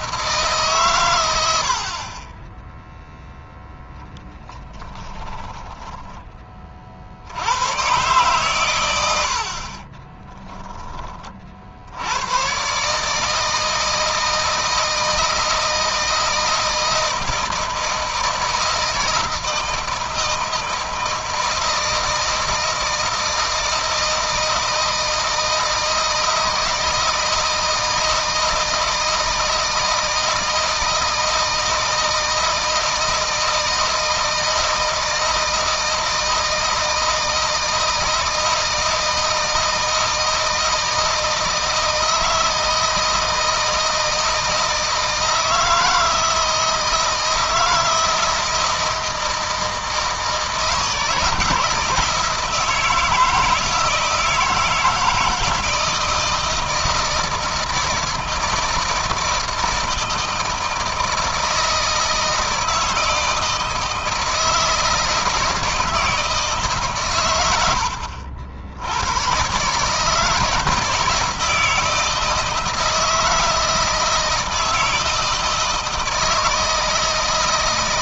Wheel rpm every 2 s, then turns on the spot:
150, 10, 10, 30, 100, 10, 120, 160, 160, 160, 160, 160, 160, 160, 160, 160, 160, 160, 160, 160, 160, 160, 160, 160, 160, 160, 160, 170, 170, 170, 160, 160, 160, 150, 80, 160, 160, 160, 160.
8-10